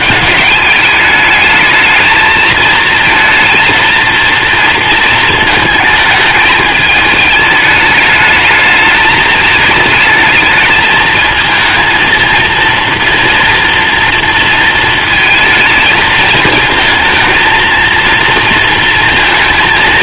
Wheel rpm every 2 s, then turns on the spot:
210, 220, 230, 210, 210, 220, 230, 230, 220, 230.
none